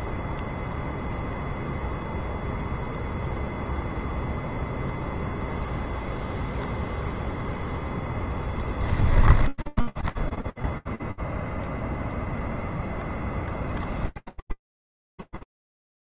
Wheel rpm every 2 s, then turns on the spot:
0, 0, 0, 0, 10, 0, 10, 0.
8-10 12-14